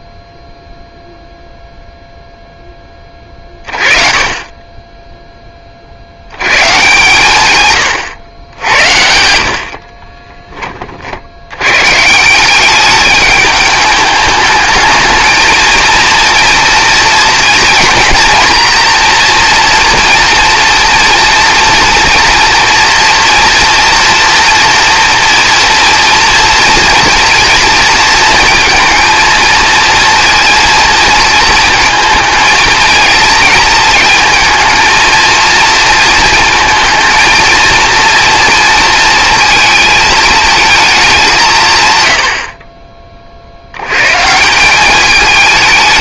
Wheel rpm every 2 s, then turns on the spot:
0, 20, 10, 130, 80, 30, 200, 220, 230, 230, 230, 230, 230, 230, 220, 230, 230, 230, 220, 230, 220, 40, 200.
none